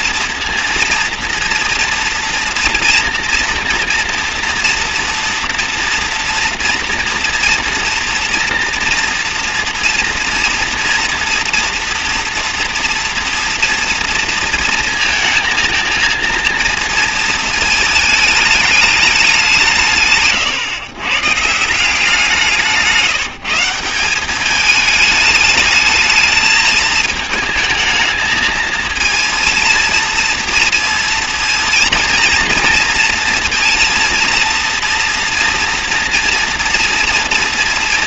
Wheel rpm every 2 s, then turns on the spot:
230, 230, 240, 230, 230, 230, 230, 230, 230, 220, 140, 170, 200, 220, 220, 230, 230, 230, 230.
none